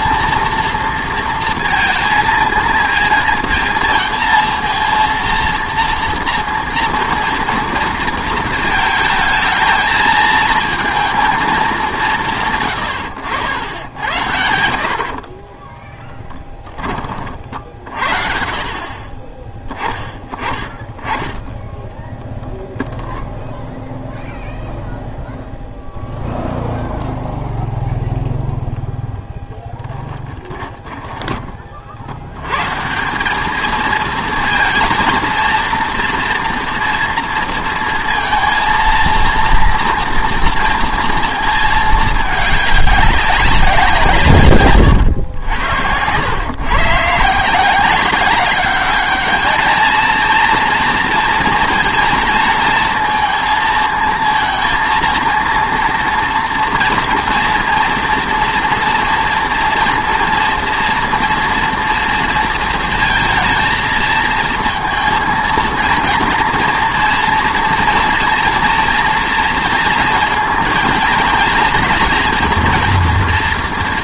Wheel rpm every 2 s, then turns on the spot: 230, 230, 230, 230, 220, 220, 130, 80, 10, 40, 30, 0, 0, 0, 0, 20, 140, 220, 230, 220, 230, 200, 140, 130, 200, 230, 230, 230, 240, 240, 230, 230, 230, 230, 230, 230, 230.
30-32